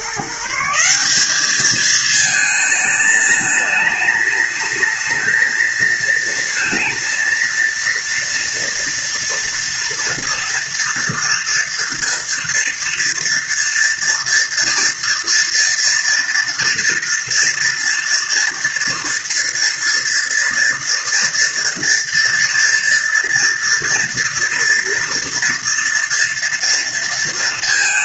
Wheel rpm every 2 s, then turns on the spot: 160, 220, 210, 230, 230, 230, 230, 230, 230, 230, 230, 230, 230, 230.
none